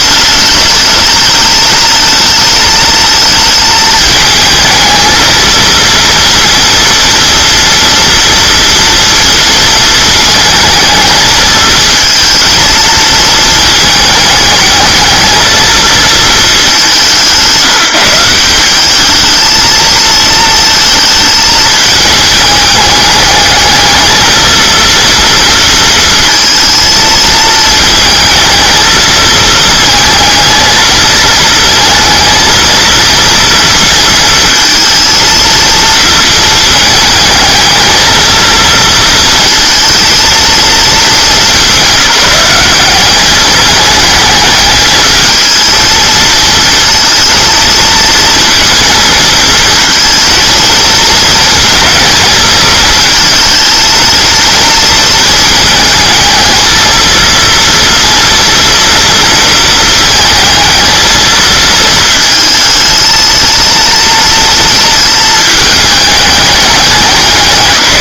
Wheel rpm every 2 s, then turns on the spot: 210, 220, 220, 230, 230, 220, 220, 220, 200, 200, 220, 210, 230, 230, 220, 230, 230, 230, 220, 230, 220, 190, 220, 230, 230, 220, 220, 230, 230, 230, 220, 220, 220, 200.
none